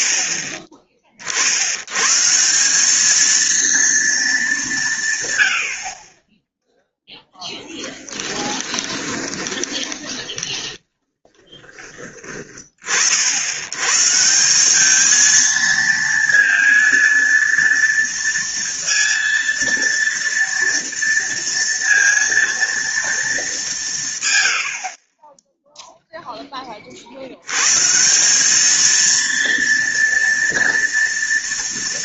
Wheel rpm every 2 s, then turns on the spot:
20, 170, 200, 10, 20, 30, 30, 190, 230, 230, 230, 230, 70, 30, 210, 230.
8-12